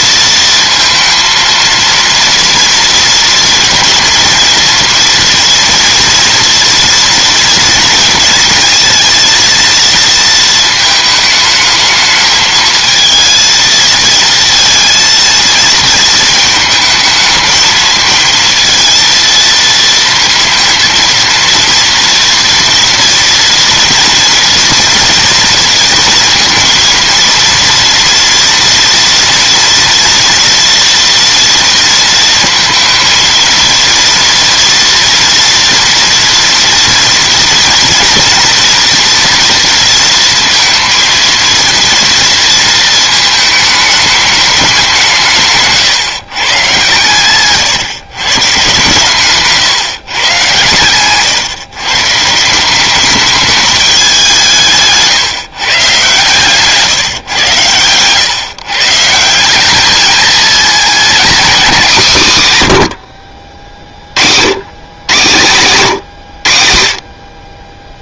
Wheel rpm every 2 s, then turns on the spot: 230, 230, 230, 230, 230, 220, 230, 230, 220, 230, 230, 240, 230, 230, 230, 230, 230, 230, 230, 240, 230, 220, 160, 130, 140, 130, 210, 150, 130, 180, 240, 70, 100, 50.
none